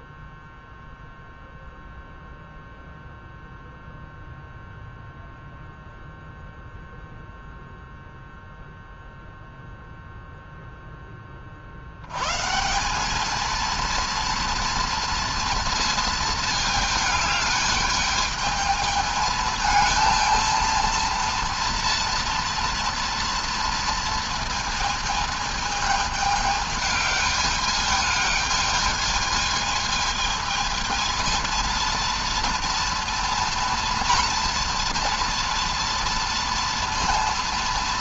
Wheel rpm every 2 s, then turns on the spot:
0, 0, 0, 0, 0, 10, 190, 230, 220, 220, 230, 230, 220, 210, 220, 220, 230, 230, 230.
none